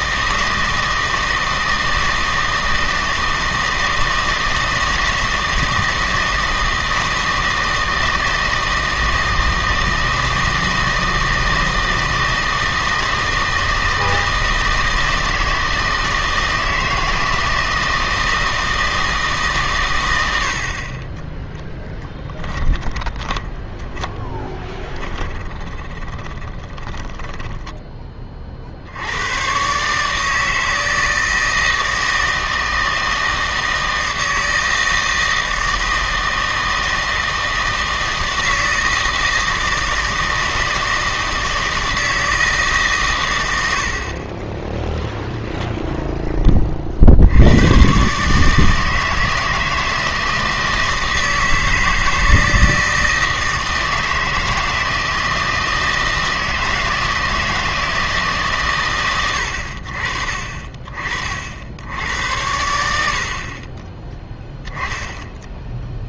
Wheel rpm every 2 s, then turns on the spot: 160, 160, 160, 160, 160, 160, 160, 160, 160, 160, 50, 20, 10, 20, 50, 160, 160, 160, 160, 160, 160, 150, 10, 40, 160, 160, 160, 160, 160, 130, 40, 90, 10.
22-28 44-46